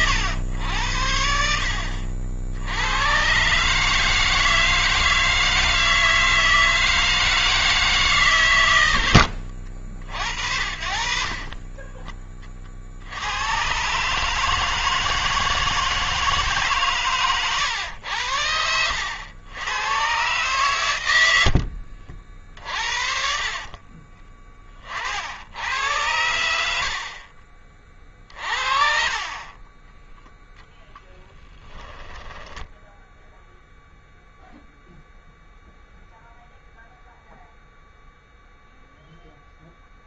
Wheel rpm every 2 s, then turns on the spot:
80, 110, 160, 160, 90, 40, 80, 160, 140, 90, 80, 60, 70, 40, 40, 10, 0, 0, 0, 0.
10-12 20-22 26-28 30-32